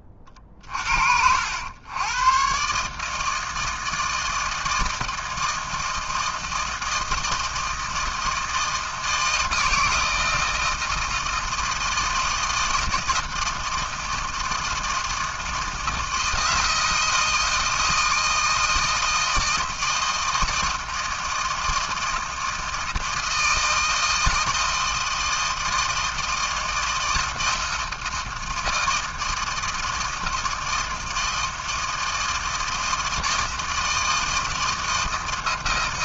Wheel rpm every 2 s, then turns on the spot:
70, 160, 160, 160, 160, 160, 160, 160, 160, 160, 160, 160, 160, 160, 160, 160, 160, 160.
none